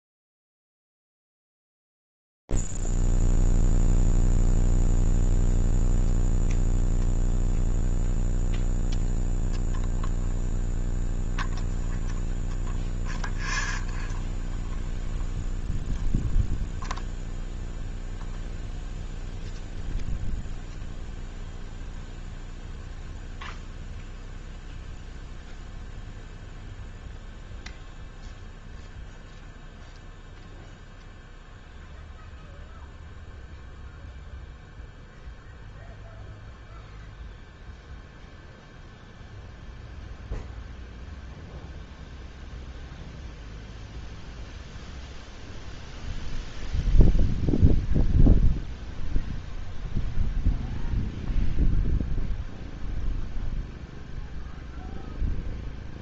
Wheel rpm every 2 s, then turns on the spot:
0, 0, 0, 0, 0, 0, 0, 0, 0, 0, 0, 0, 0, 0, 0, 0, 0, 0, 0, 0, 0, 0, 0, 0, 0, 0, 0, 0.
none